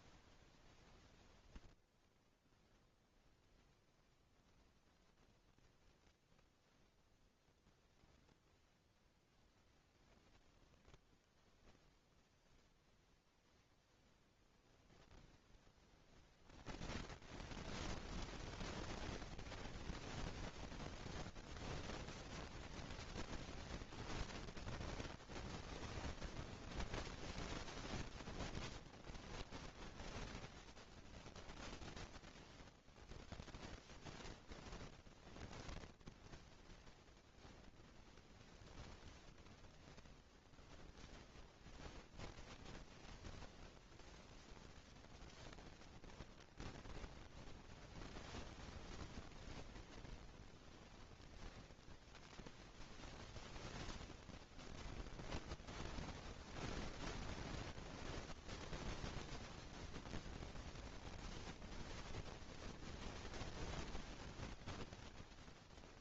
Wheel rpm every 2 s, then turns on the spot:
0, 0, 0, 0, 0, 0, 0, 0, 30, 0, 0, 0, 0, 0, 0, 0, 0, 0, 0, 0, 0, 0, 0, 20, 0, 0, 0, 0, 0, 0, 0, 0, 0.
none